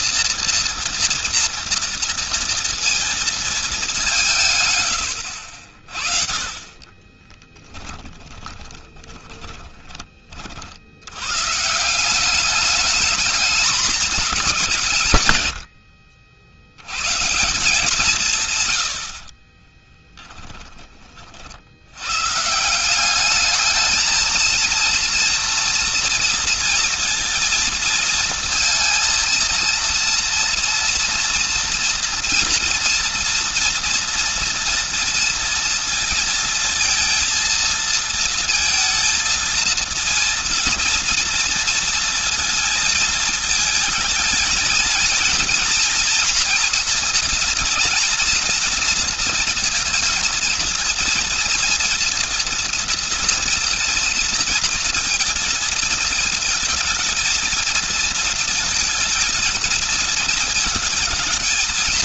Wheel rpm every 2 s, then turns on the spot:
230, 230, 140, 40, 30, 50, 200, 190, 80, 130, 10, 150, 230, 230, 230, 230, 230, 230, 230, 230, 230, 230, 220, 230, 230, 230, 230, 230, 220, 230, 220.
4-10